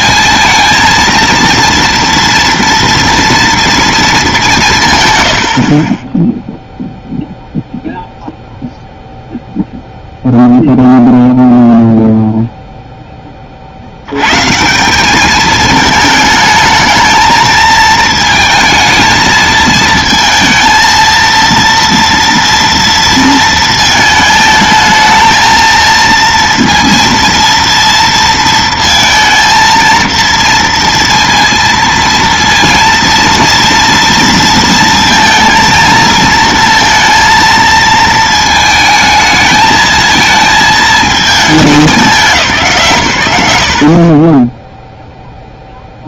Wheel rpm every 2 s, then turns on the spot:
230, 230, 170, 0, 0, 0, 0, 140, 210, 220, 220, 230, 220, 230, 230, 230, 230, 230, 230, 220, 220, 160, 10.
none